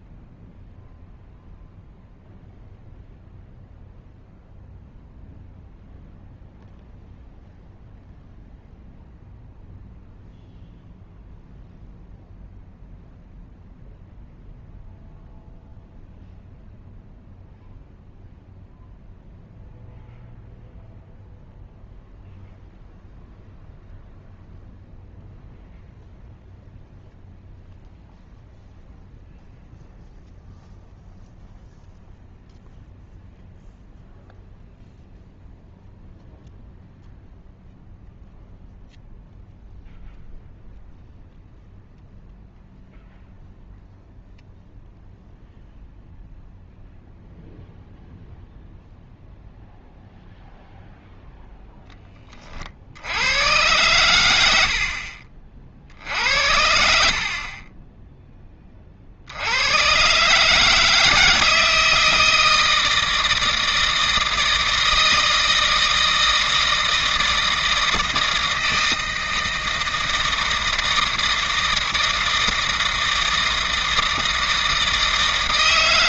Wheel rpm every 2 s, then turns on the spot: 0, 0, 0, 0, 0, 0, 0, 0, 0, 0, 0, 0, 0, 0, 0, 0, 0, 0, 0, 0, 0, 0, 0, 0, 0, 0, 50, 70, 70, 30, 150, 160, 160, 160, 160, 160, 160, 160.
none